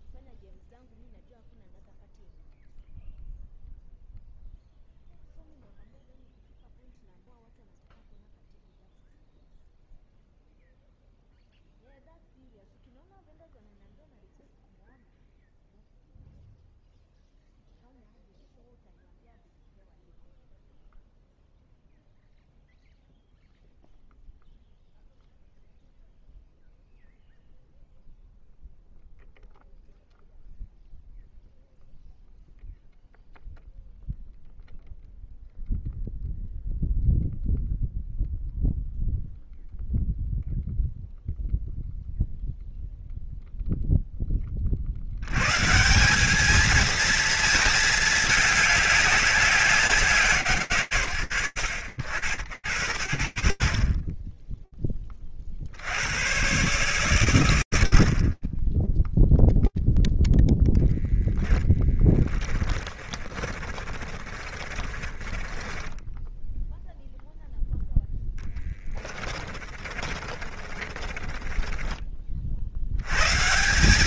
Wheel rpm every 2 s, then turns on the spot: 0, 0, 0, 0, 0, 0, 0, 0, 0, 0, 0, 0, 0, 0, 0, 0, 0, 0, 0, 0, 0, 0, 20, 190, 220, 180, 90, 10, 110, 40, 0, 20, 30, 10, 10, 30, 50.
62-72